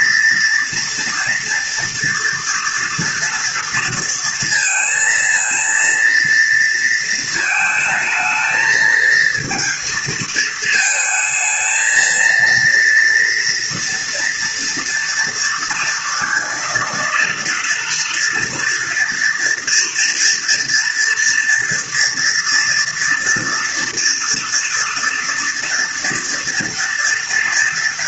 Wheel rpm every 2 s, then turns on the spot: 230, 230, 230, 230, 230, 220, 230, 230, 230, 230, 230, 240, 230, 230.
none